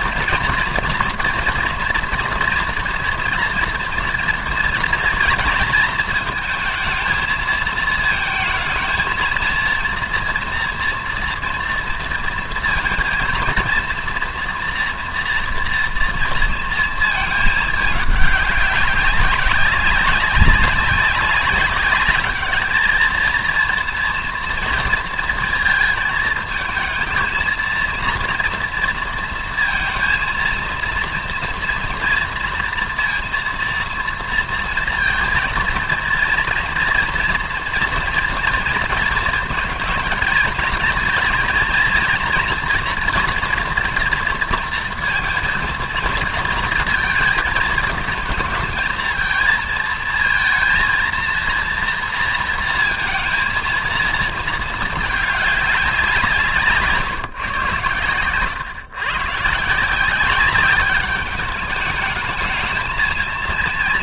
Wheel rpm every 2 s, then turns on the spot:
230, 230, 230, 220, 220, 230, 230, 230, 230, 200, 190, 210, 230, 220, 230, 230, 230, 230, 230, 230, 230, 230, 230, 230, 220, 230, 230, 230, 150, 130, 200, 220.
none